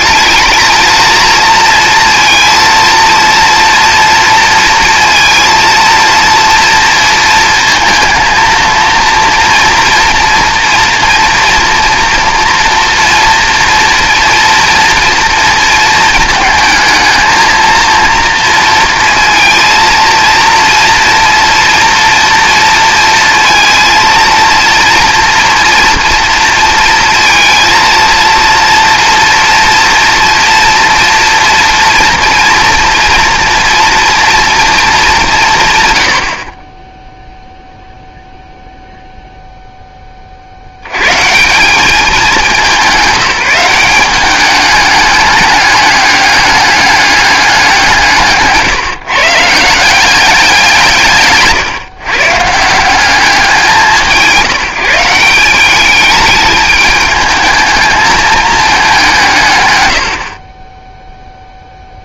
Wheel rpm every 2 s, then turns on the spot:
230, 230, 230, 230, 230, 230, 230, 230, 220, 230, 230, 230, 230, 230, 240, 240, 230, 230, 30, 0, 80, 200, 200, 200, 150, 170, 170, 170, 210, 210, 20.
none